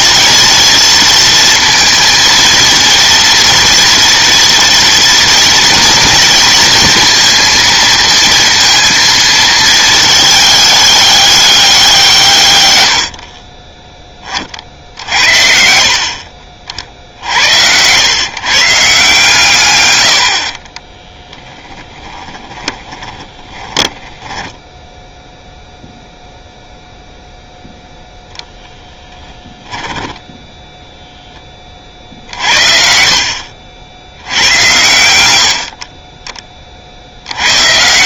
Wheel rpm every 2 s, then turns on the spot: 230, 230, 230, 230, 230, 210, 100, 50, 60, 140, 30, 20, 10, 0, 10, 10, 60, 90, 30.
12-14 20-26